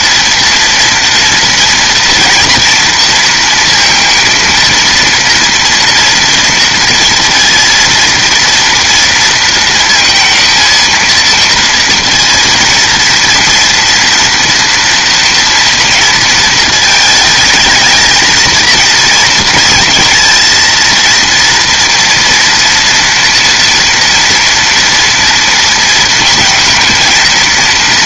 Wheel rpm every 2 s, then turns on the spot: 230, 240, 230, 230, 230, 230, 230, 230, 220, 220, 230, 230, 230, 230.
none